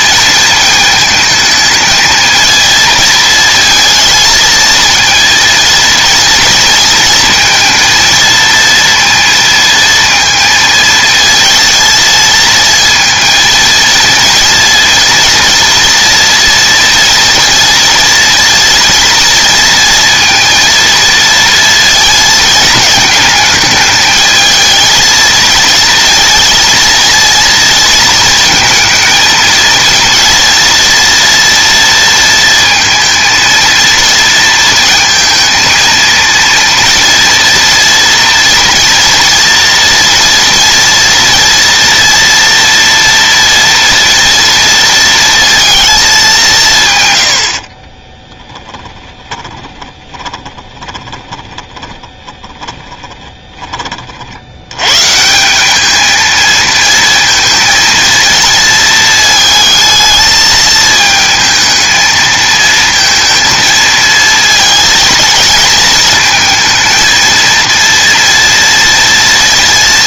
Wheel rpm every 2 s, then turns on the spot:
220, 230, 220, 230, 230, 230, 230, 230, 230, 230, 230, 220, 220, 230, 230, 230, 230, 230, 230, 230, 230, 230, 230, 190, 20, 20, 20, 80, 230, 230, 220, 220, 230, 220, 230.
48-54